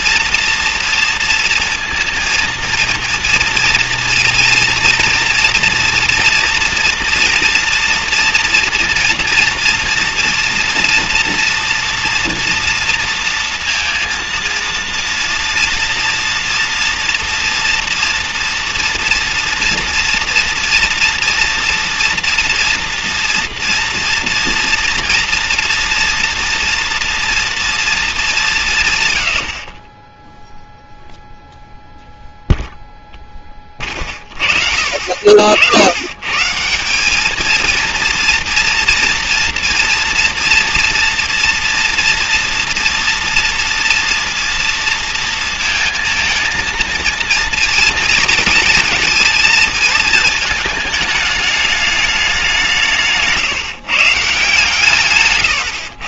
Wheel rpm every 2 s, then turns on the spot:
230, 230, 230, 230, 230, 240, 230, 230, 230, 240, 230, 230, 240, 230, 150, 0, 0, 40, 150, 230, 240, 230, 230, 230, 230, 220, 180, 150.
none